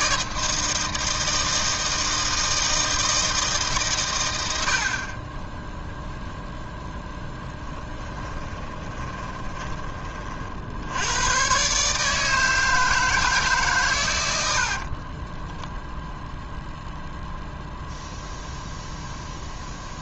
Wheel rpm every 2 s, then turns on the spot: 160, 160, 80, 0, 20, 70, 160, 70, 0, 0.
8-10 14-16